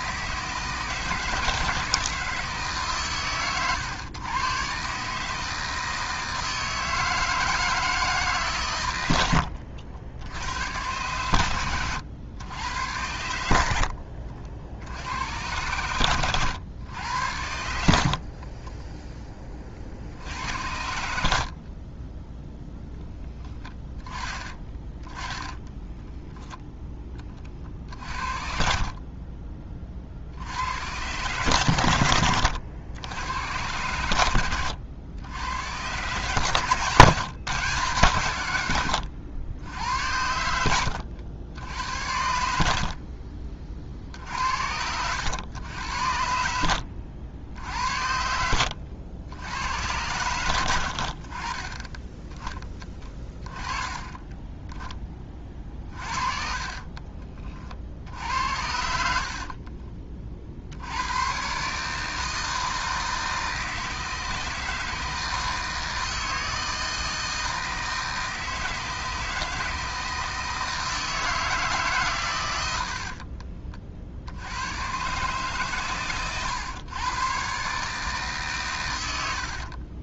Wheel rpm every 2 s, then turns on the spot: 160, 150, 130, 160, 130, 100, 100, 60, 100, 30, 80, 0, 20, 0, 50, 90, 90, 100, 140, 110, 80, 60, 70, 80, 80, 90, 10, 10, 40, 60, 70, 160, 160, 160, 160, 160, 100, 100, 120, 120.
18-20 24-26 28-30 40-42 44-46 48-50 56-60